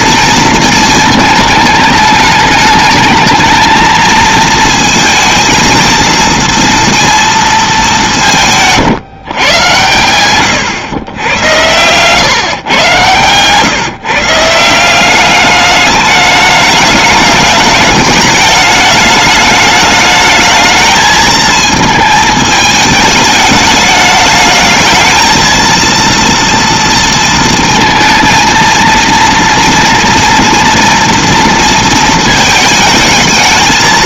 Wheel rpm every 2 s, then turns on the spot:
220, 210, 230, 230, 140, 120, 120, 180, 210, 210, 220, 210, 220, 230, 230, 230, 220.
none